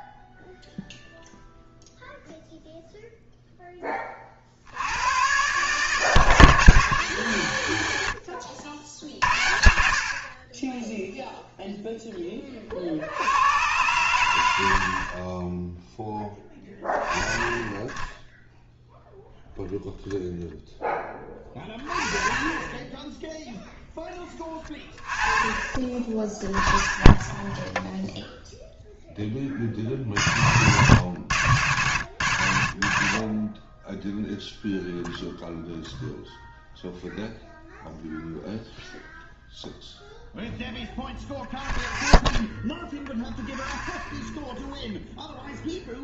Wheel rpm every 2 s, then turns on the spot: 0, 0, 60, 140, 70, 20, 40, 60, 20, 0, 10, 20, 20, 30, 0, 100, 80, 0, 0, 0, 0, 0, 0.
26-28